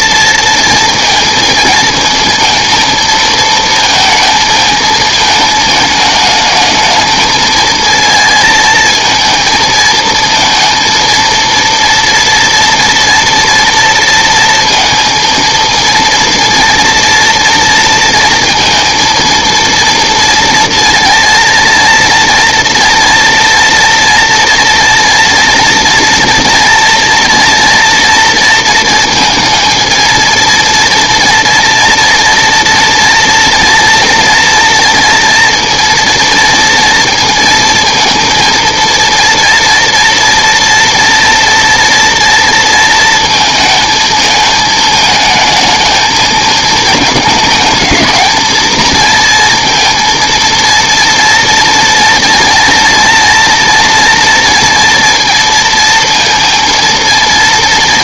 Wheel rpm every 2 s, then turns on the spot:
230, 230, 220, 220, 230, 230, 230, 230, 230, 230, 230, 230, 230, 240, 230, 230, 230, 230, 230, 230, 230, 230, 220, 220, 220, 230, 230, 230, 230.
none